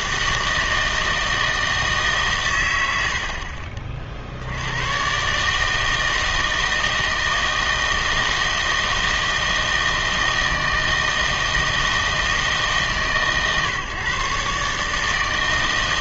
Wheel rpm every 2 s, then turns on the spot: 160, 90, 100, 160, 160, 160, 150, 140.
none